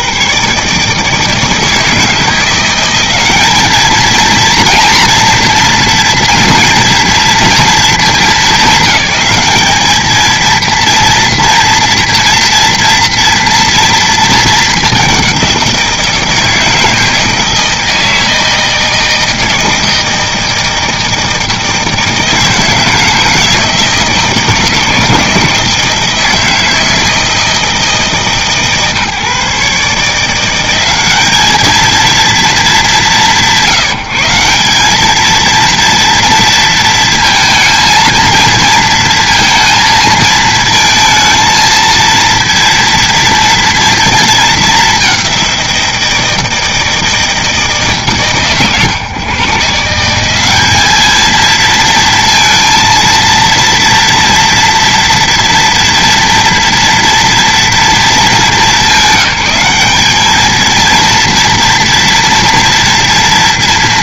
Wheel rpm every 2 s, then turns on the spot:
100, 160, 220, 230, 220, 210, 230, 230, 170, 160, 160, 160, 160, 160, 160, 150, 220, 150, 230, 230, 230, 230, 230, 170, 140, 160, 230, 230, 230, 210, 200, 230.
none